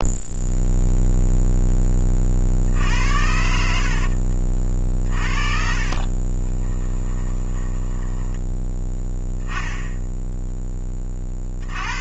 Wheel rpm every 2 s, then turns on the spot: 0, 70, 50, 20, 10, 30.
4-8